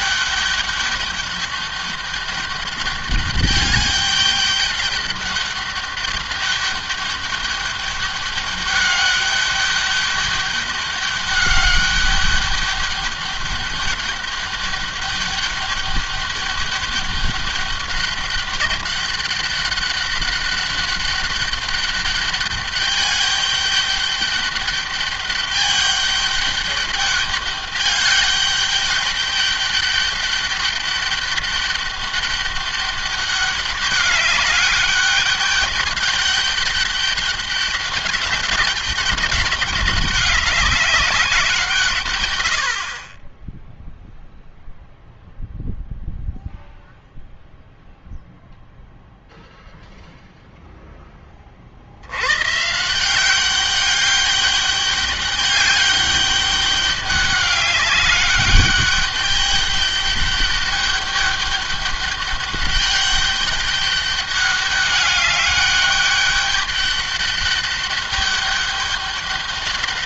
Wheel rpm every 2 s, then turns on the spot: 200, 200, 210, 200, 200, 200, 200, 200, 200, 200, 200, 200, 200, 200, 200, 200, 200, 200, 200, 200, 200, 80, 0, 0, 0, 0, 150, 200, 200, 200, 200, 200, 200, 200, 200.
none